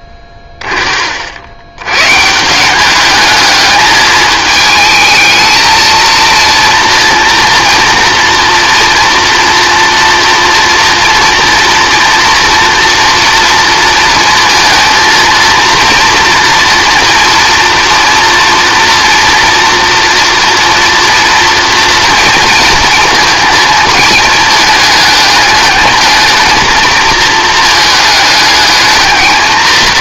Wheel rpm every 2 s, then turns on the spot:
30, 180, 220, 230, 240, 230, 230, 230, 240, 230, 230, 230, 220, 220, 210.
none